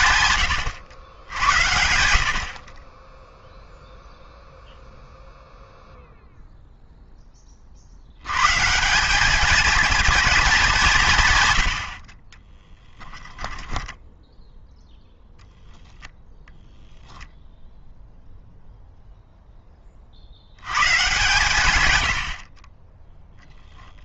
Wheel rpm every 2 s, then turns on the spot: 120, 40, 0, 0, 150, 200, 10, 0, 0, 0, 110, 40.
0-2 12-14 22-24